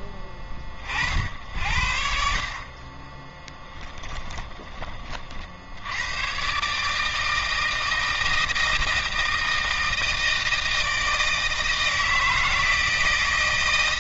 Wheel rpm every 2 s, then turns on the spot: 30, 20, 40, 140, 160, 160, 160.
none